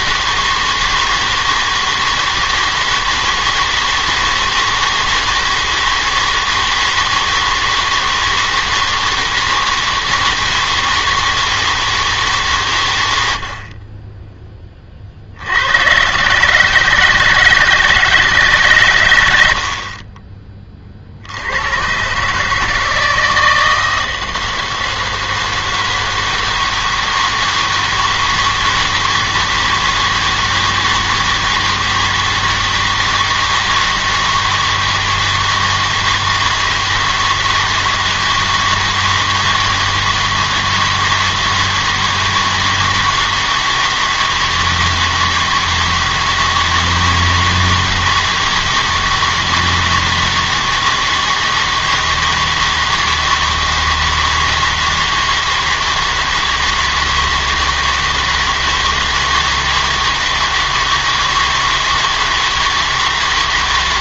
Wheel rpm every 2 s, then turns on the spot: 160, 160, 160, 160, 160, 160, 140, 20, 150, 140, 30, 150, 160, 160, 160, 160, 160, 160, 160, 160, 160, 160, 160, 160, 160, 160, 160, 160, 160, 160, 160, 160.
none